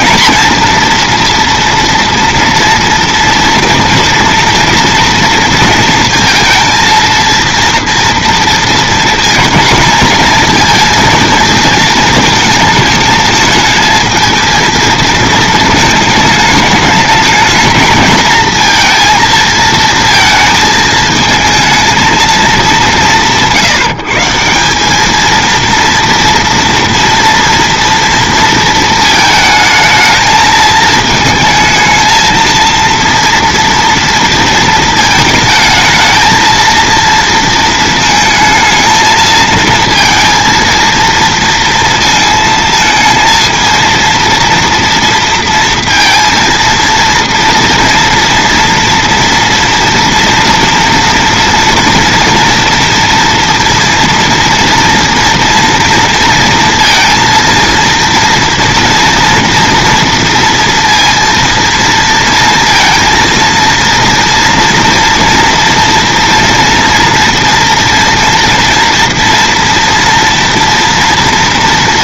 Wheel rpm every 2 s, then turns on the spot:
230, 230, 230, 230, 230, 220, 220, 220, 220, 230, 220, 220, 170, 240, 230, 220, 230, 230, 230, 220, 230, 230, 230, 230, 230, 230, 230, 230, 230, 230, 230, 230, 230, 230, 230, 230.
none